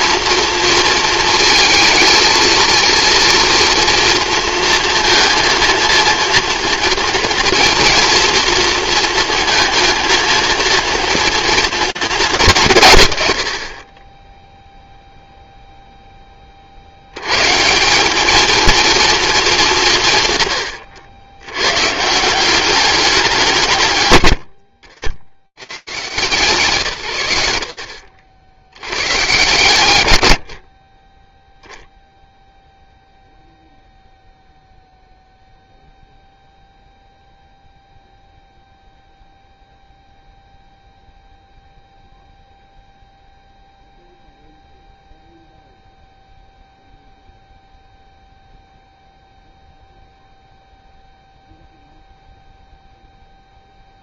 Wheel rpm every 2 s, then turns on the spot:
230, 230, 230, 230, 230, 230, 190, 0, 50, 230, 110, 190, 50, 130, 80, 40, 0, 0, 0, 0, 0, 0, 0, 0, 0, 0, 0.
none